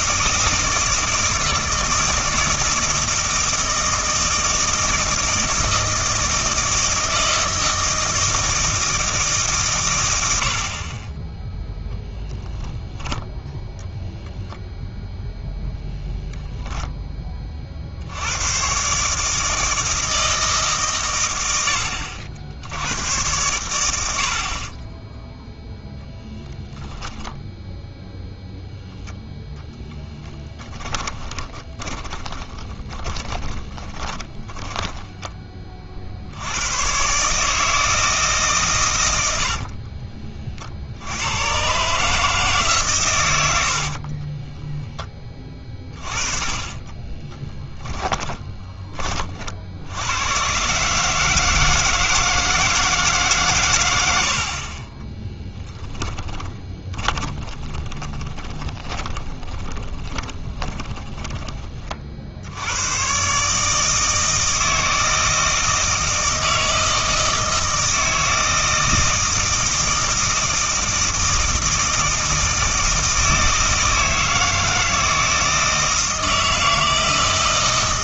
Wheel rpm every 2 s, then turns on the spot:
160, 160, 160, 160, 160, 30, 10, 0, 10, 130, 150, 80, 30, 10, 10, 10, 30, 30, 100, 130, 60, 130, 10, 30, 20, 140, 160, 40, 10, 20, 20, 100, 160, 160, 160, 160, 160, 160, 160.
12-14 24-26 30-36 46-48 56-62